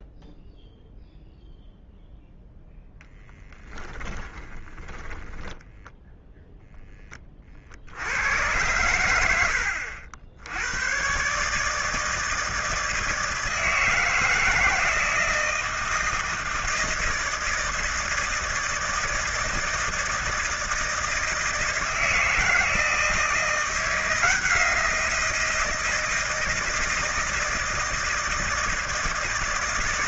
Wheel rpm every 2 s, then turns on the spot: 0, 0, 10, 0, 90, 100, 160, 160, 160, 160, 160, 160, 170, 160, 160.
4-6